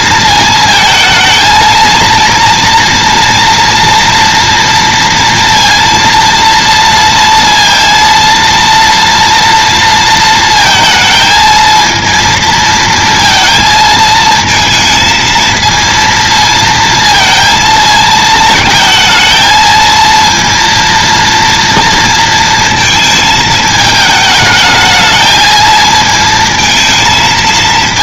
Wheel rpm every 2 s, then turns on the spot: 220, 230, 230, 230, 230, 230, 230, 230, 230, 220, 230, 220, 220, 230.
none